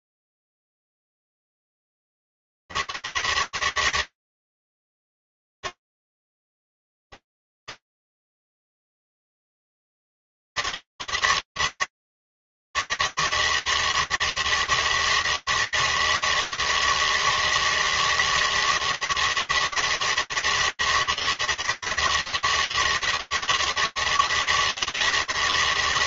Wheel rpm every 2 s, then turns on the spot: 130, 160, 160, 140, 160, 160, 160, 160, 160, 160, 160, 160, 160.
none